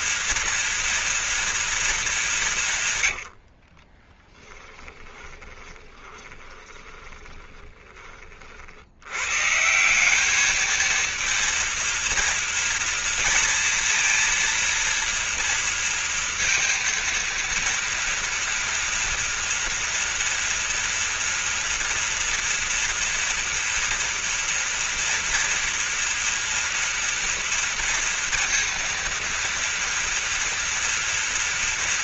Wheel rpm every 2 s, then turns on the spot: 230, 160, 10, 10, 70, 220, 230, 230, 230, 230, 230, 230, 230, 230, 230, 230.
4-8